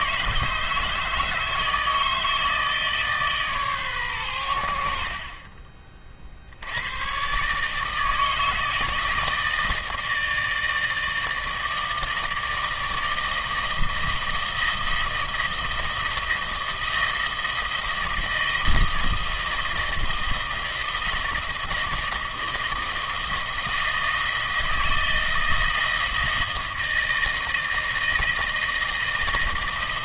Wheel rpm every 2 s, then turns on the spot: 160, 150, 70, 100, 160, 160, 160, 160, 160, 160, 160, 160, 160, 160, 160.
none